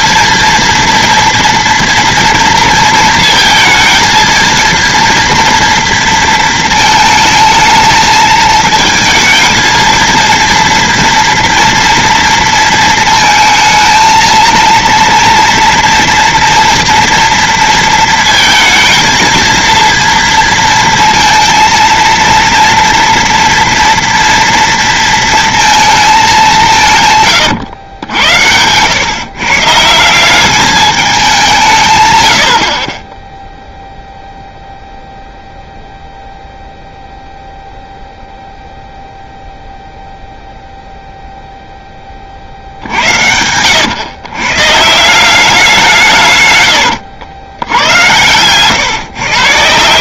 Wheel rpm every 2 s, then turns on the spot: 230, 230, 230, 230, 220, 230, 230, 230, 240, 230, 230, 230, 230, 180, 90, 200, 60, 0, 0, 0, 0, 70, 140, 110, 120.
none